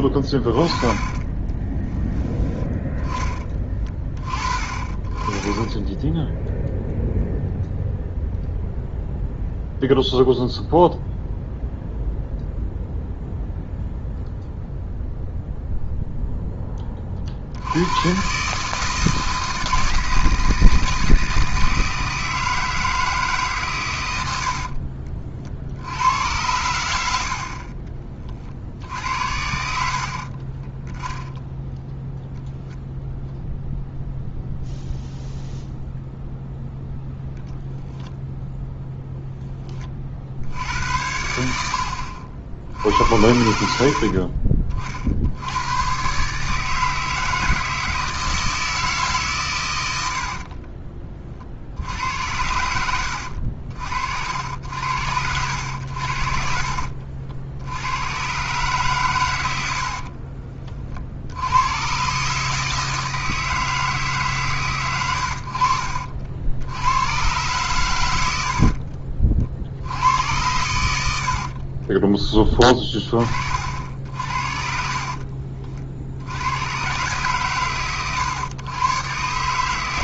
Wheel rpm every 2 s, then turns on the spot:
20, 10, 30, 0, 0, 0, 0, 0, 10, 150, 160, 160, 60, 90, 60, 30, 0, 0, 0, 0, 80, 70, 50, 150, 160, 40, 80, 80, 60, 130, 40, 150, 130, 80, 60, 100, 20, 60, 90, 110.
0-2 24-26 30-32 50-52 68-70 74-76